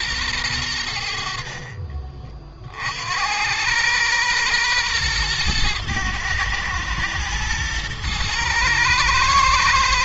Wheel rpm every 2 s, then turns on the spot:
90, 60, 120, 110, 110.
none